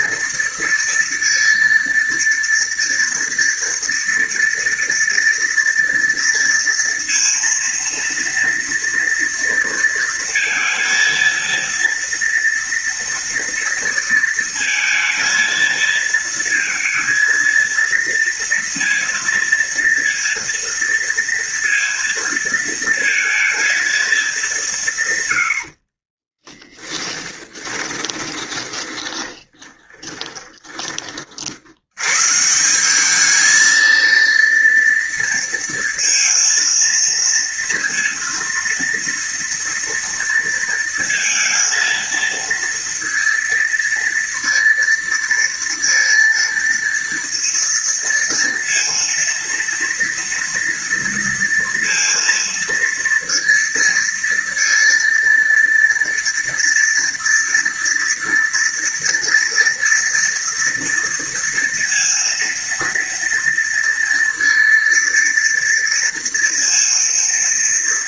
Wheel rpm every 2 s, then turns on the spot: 230, 230, 230, 230, 230, 230, 230, 220, 230, 230, 230, 230, 170, 10, 30, 30, 170, 230, 230, 230, 230, 230, 230, 230, 230, 230, 230, 230, 230, 230, 230, 230, 230, 230.
26-32